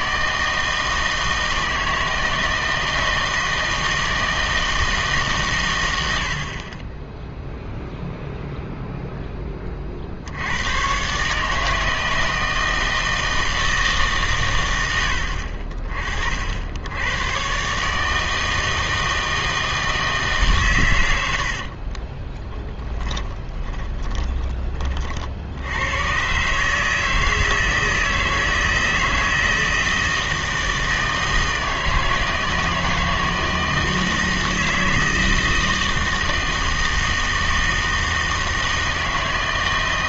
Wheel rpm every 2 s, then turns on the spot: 160, 160, 160, 40, 0, 100, 160, 120, 70, 160, 140, 10, 20, 140, 160, 160, 160, 160, 160, 160.
22-24